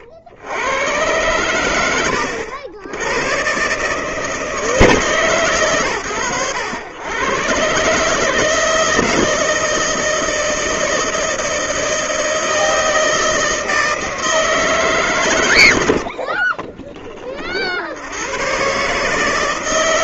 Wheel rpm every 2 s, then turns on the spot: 80, 70, 160, 100, 160, 160, 160, 160, 30, 120.
16-18